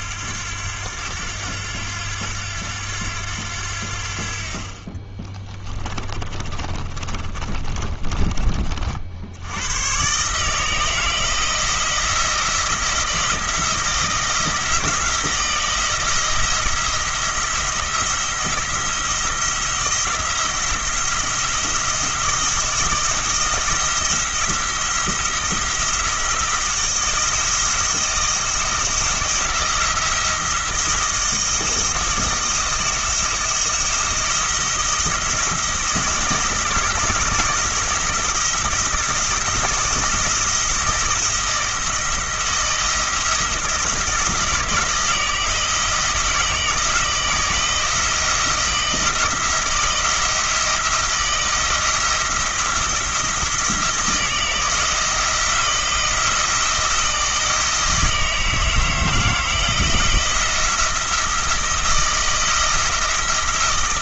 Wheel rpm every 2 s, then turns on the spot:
90, 90, 50, 30, 30, 150, 170, 170, 160, 170, 170, 170, 170, 170, 170, 170, 170, 170, 170, 170, 170, 170, 160, 170, 160, 170, 170, 160, 170, 160, 170, 160.
6-8